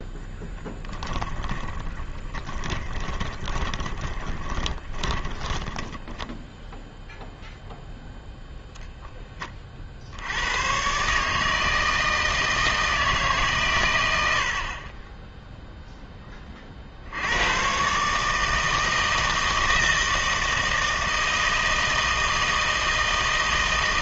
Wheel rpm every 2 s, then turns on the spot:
20, 20, 20, 0, 0, 110, 160, 50, 40, 160, 160, 160.
0-6